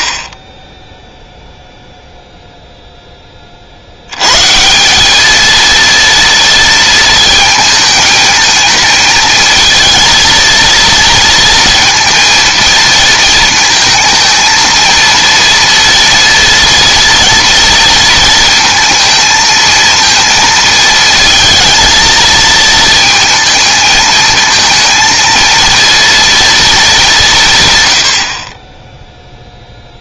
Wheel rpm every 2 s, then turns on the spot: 10, 0, 160, 230, 220, 230, 230, 230, 230, 230, 220, 230, 230, 210, 10.
none